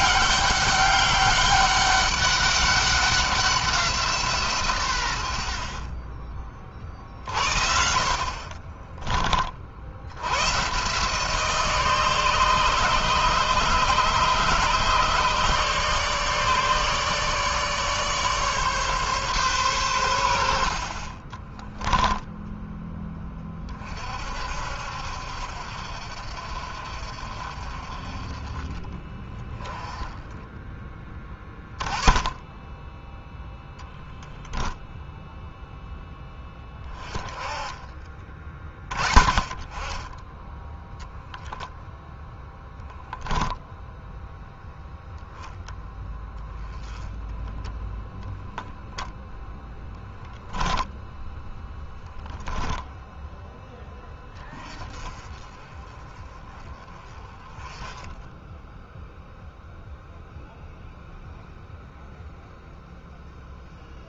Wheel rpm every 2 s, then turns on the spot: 200, 200, 120, 40, 30, 140, 150, 150, 150, 140, 50, 10, 60, 50, 30, 10, 10, 0, 10, 30, 0, 0, 0, 10, 0, 0, 10, 20, 20, 0, 0, 0.
8-10